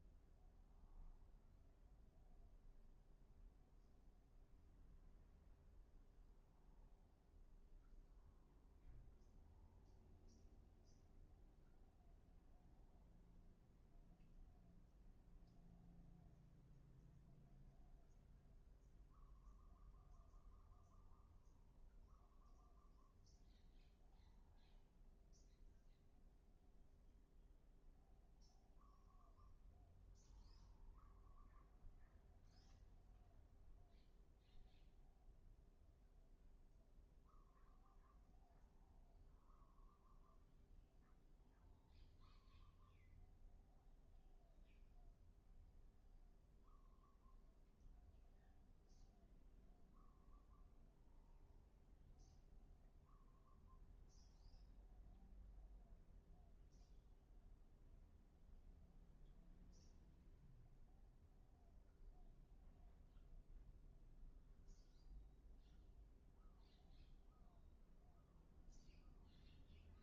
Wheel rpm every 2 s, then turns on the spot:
0, 0, 0, 0, 0, 0, 0, 0, 0, 0, 0, 0, 0, 0, 0, 0, 0, 0, 0, 0, 0, 0, 0, 0, 0, 0, 0, 0, 0, 0, 0, 0, 0, 0, 0.
none